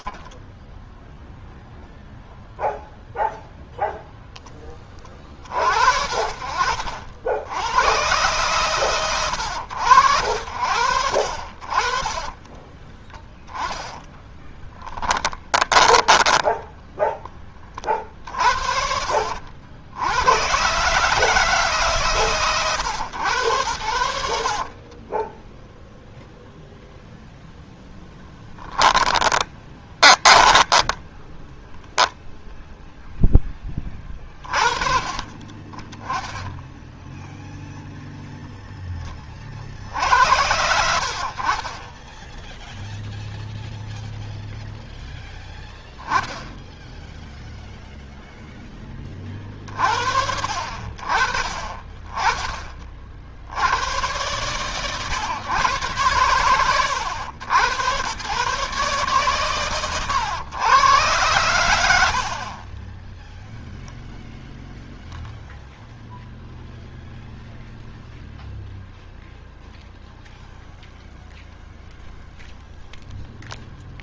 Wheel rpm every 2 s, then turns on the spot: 0, 0, 50, 110, 90, 40, 10, 10, 20, 70, 140, 100, 20, 0, 10, 10, 0, 30, 0, 20, 70, 0, 0, 0, 20, 40, 30, 130, 100, 130, 110, 10, 0, 0, 0, 0, 0.
10-16 24-26 28-32